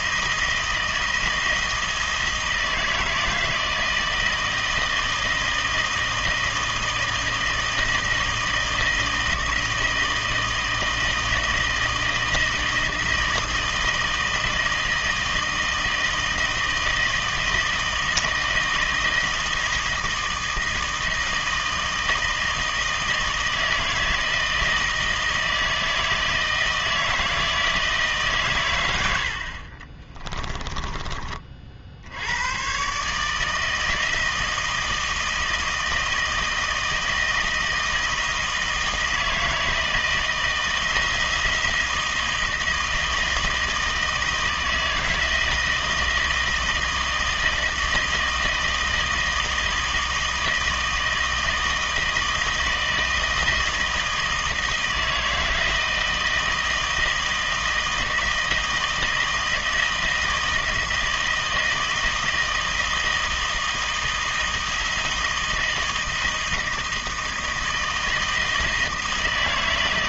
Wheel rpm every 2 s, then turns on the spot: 160, 160, 160, 160, 160, 160, 160, 160, 160, 160, 160, 160, 160, 160, 120, 20, 120, 160, 160, 160, 160, 160, 160, 160, 160, 160, 160, 160, 160, 160, 160, 160, 160, 160, 160.
30-32